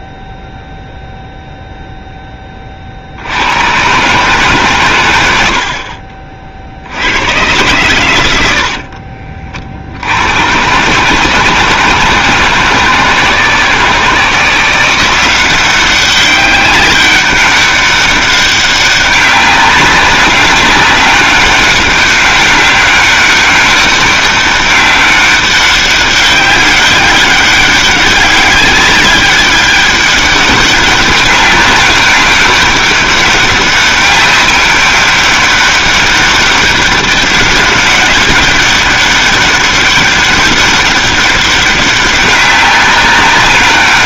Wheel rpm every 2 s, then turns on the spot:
0, 20, 140, 50, 70, 120, 160, 170, 200, 200, 190, 200, 200, 190, 200, 200, 200, 200, 200, 200, 200, 200.
none